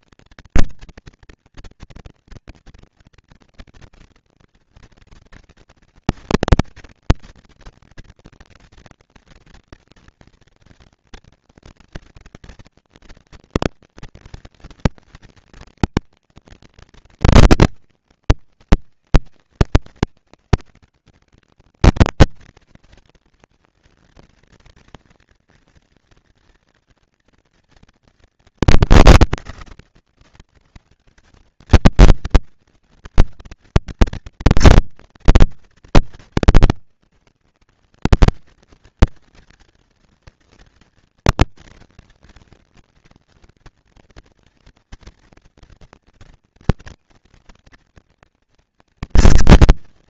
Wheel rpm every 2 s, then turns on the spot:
230, 230, 230, 230, 230, 230, 230, 230, 230, 170, 190, 230, 230, 230, 210, 190, 230, 230, 230, 230, 230, 230, 230, 230, 230.
none